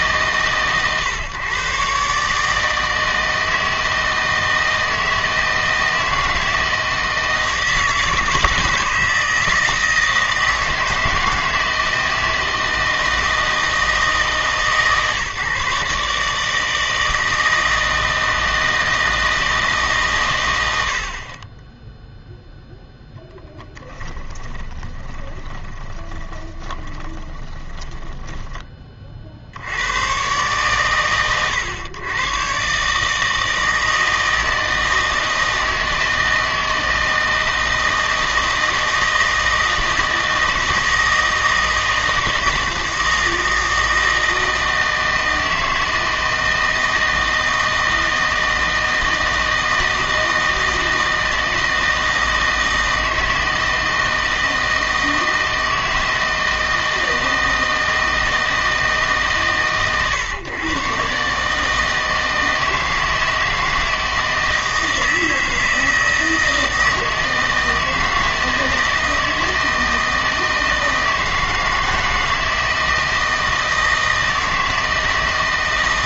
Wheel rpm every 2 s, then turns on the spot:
130, 160, 160, 160, 160, 160, 160, 150, 150, 160, 90, 0, 20, 20, 20, 120, 130, 160, 160, 160, 160, 160, 160, 160, 160, 160, 160, 160, 160, 160, 130, 160, 160, 160, 160, 160, 160, 160.
24-28